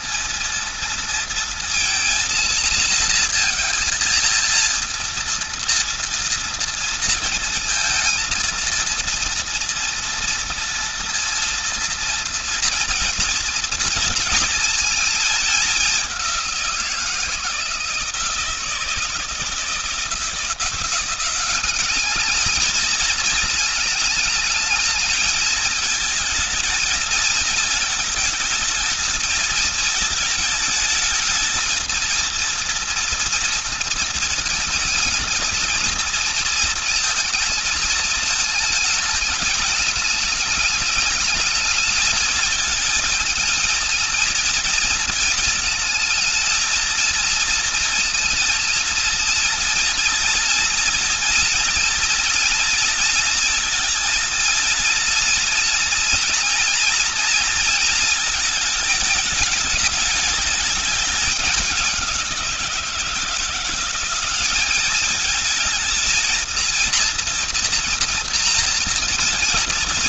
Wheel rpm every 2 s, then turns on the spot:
230, 230, 230, 230, 230, 230, 230, 230, 180, 160, 170, 210, 220, 220, 220, 220, 230, 230, 230, 220, 220, 220, 230, 230, 230, 230, 230, 230, 240, 220, 210, 180, 200, 230, 230.
none